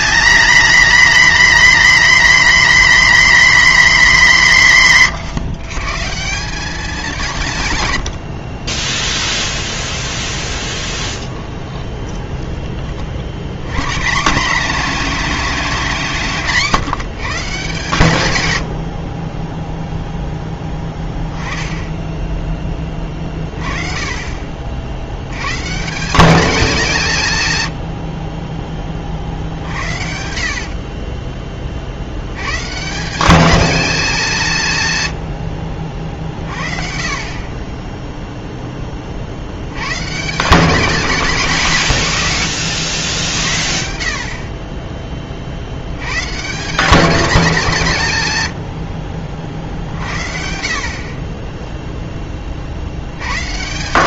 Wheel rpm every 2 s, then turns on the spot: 250, 270, 190, 190, 20, 20, 20, 210, 180, 100, 10, 20, 60, 190, 30, 40, 130, 150, 40, 20, 200, 90, 20, 190, 90, 60, 40.
10-12 30-32